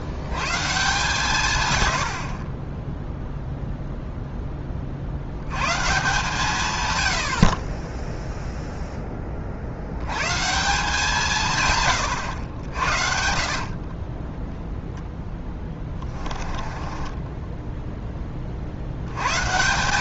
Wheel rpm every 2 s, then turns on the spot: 140, 20, 30, 130, 0, 150, 80, 0, 20, 60.
16-18